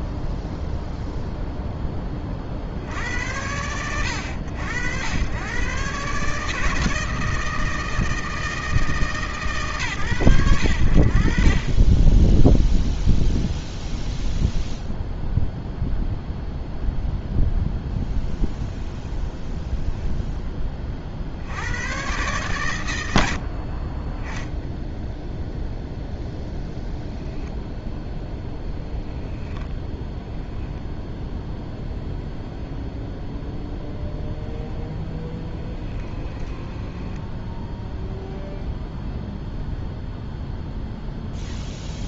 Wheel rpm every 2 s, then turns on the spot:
0, 60, 80, 150, 160, 80, 0, 0, 0, 0, 10, 110, 0, 10, 10, 10, 0, 0, 10, 0, 0.
30-32 36-38